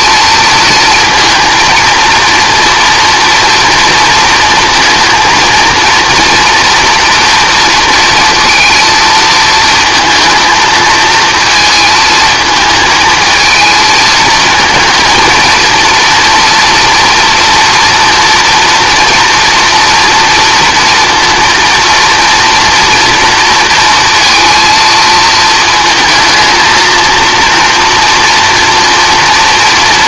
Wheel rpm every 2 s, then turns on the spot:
230, 230, 230, 240, 230, 220, 220, 220, 230, 230, 230, 230, 230, 220, 230.
none